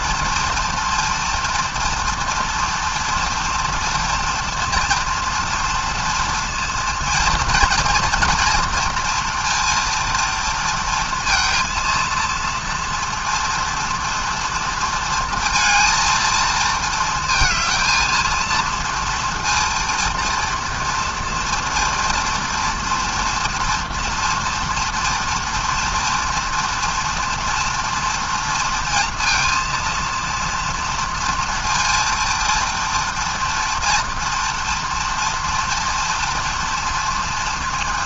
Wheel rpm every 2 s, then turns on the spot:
230, 230, 230, 230, 230, 230, 230, 230, 220, 230, 230, 230, 230, 230, 230, 240, 230, 230, 230.
none